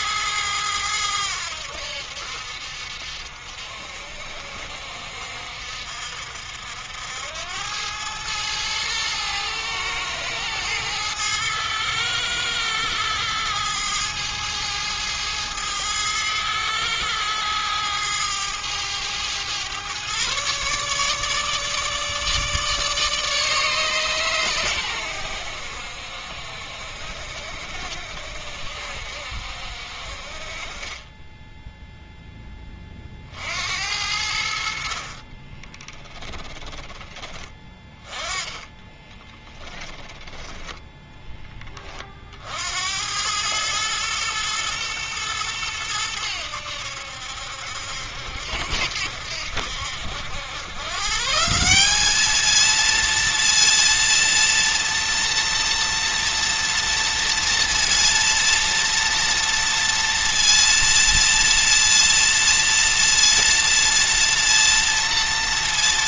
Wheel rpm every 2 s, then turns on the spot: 90, 60, 60, 80, 110, 110, 110, 110, 110, 110, 150, 150, 100, 60, 60, 20, 40, 50, 20, 10, 10, 90, 110, 80, 80, 130, 230, 230, 230, 230, 230, 230, 230.
34-36 38-42